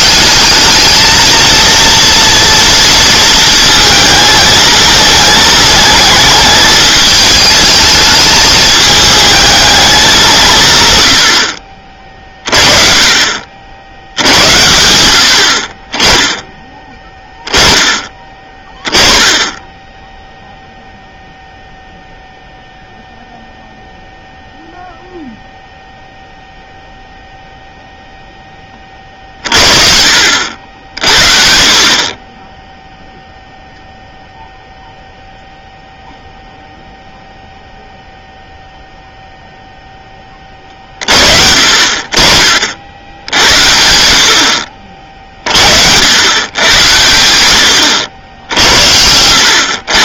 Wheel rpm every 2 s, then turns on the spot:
210, 230, 220, 220, 210, 140, 30, 90, 10, 20, 0, 0, 0, 0, 20, 60, 10, 0, 0, 0, 30, 60, 50, 100, 70.
48-50